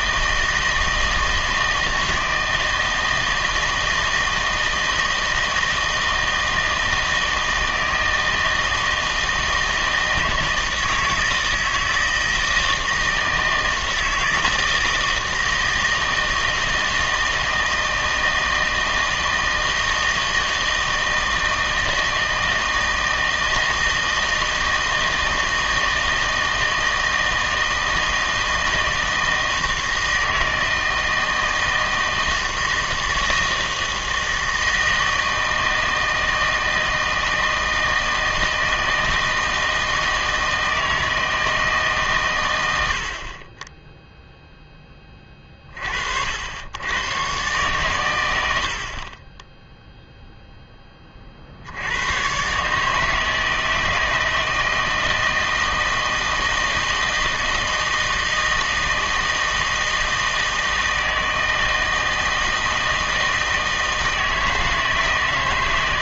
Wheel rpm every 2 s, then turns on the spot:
160, 160, 160, 160, 160, 160, 160, 160, 160, 160, 160, 160, 160, 160, 160, 160, 160, 160, 160, 160, 160, 100, 10, 90, 70, 10, 140, 160, 160, 160, 160, 160, 160.
none